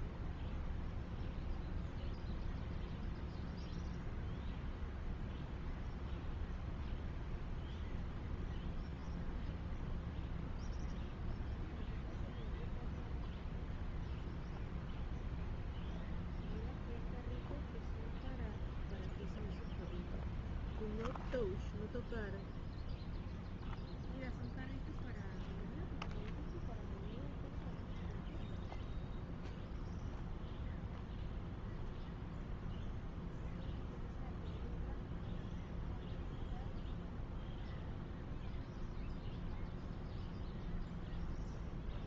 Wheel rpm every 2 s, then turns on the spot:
0, 0, 0, 0, 0, 0, 0, 0, 0, 0, 0, 0, 0, 0, 0, 0, 0, 0, 0, 0, 0.
none